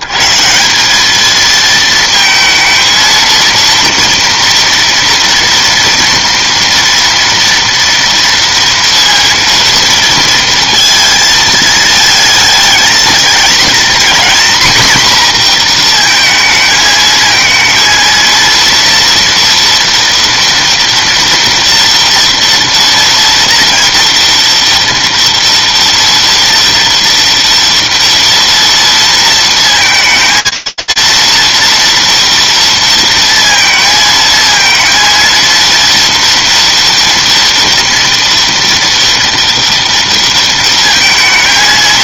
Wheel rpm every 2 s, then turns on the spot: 150, 220, 230, 230, 230, 230, 220, 240, 220, 230, 240, 230, 230, 230, 230, 230, 230, 220, 230, 230, 230.
none